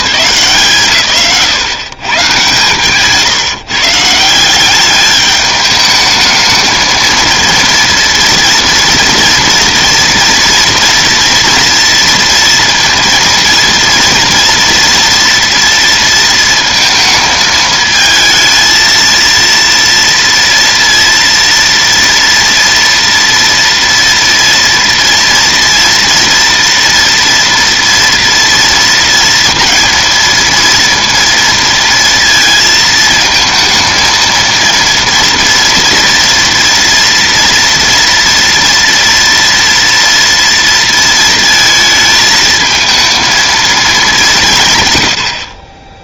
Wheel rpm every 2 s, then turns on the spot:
160, 130, 190, 220, 240, 230, 230, 230, 230, 220, 230, 230, 230, 230, 230, 230, 220, 230, 230, 230, 230, 220, 130.
none